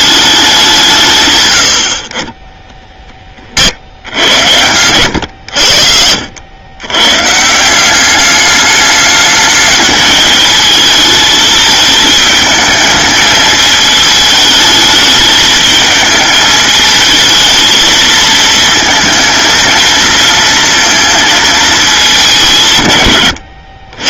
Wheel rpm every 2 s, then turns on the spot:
200, 30, 90, 100, 210, 220, 220, 210, 210, 220, 230, 170.
none